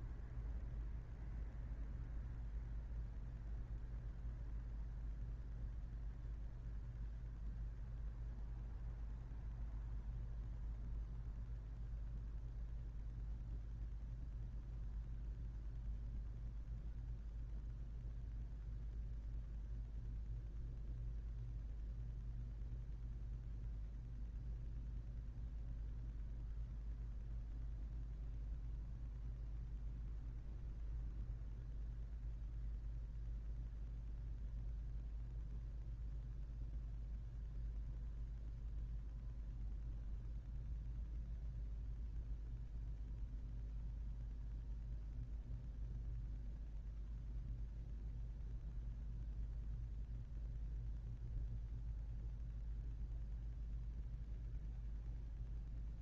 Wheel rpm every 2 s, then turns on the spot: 0, 0, 0, 0, 0, 0, 0, 0, 0, 0, 0, 0, 0, 0, 0, 0, 0, 0, 0, 0, 0, 0, 0, 0, 0, 0, 0, 0.
none